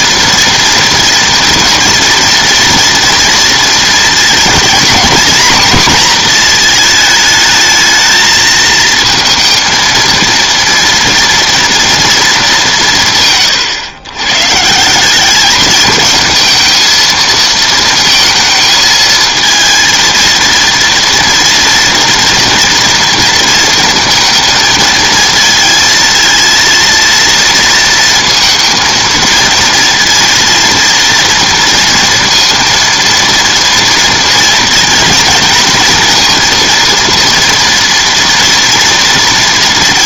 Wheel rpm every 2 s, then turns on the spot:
230, 230, 240, 220, 230, 230, 140, 190, 220, 220, 230, 230, 220, 230, 230, 230, 230, 230, 230, 230.
none